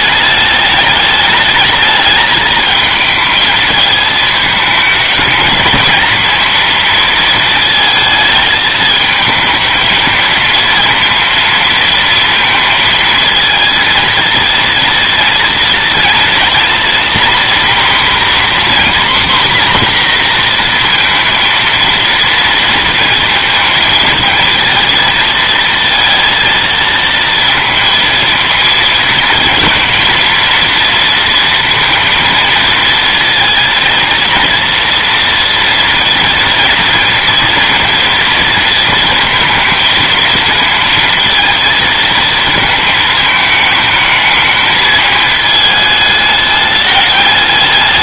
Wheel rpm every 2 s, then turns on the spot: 210, 220, 210, 230, 220, 230, 230, 230, 240, 250, 240, 230, 230, 230, 220, 230, 230, 230, 230, 230, 230, 220, 220, 210.
none